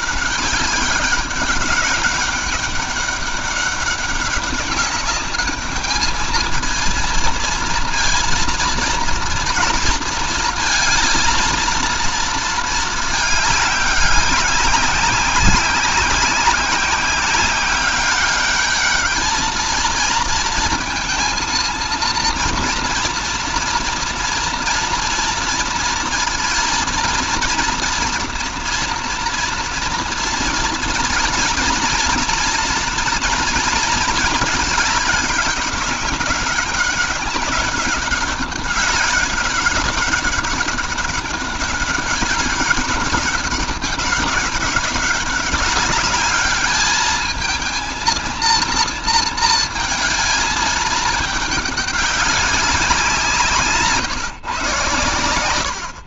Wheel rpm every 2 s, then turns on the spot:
200, 200, 200, 220, 230, 230, 220, 200, 190, 210, 230, 230, 240, 230, 230, 230, 230, 220, 200, 200, 200, 200, 200, 210, 230, 210, 190, 130.
none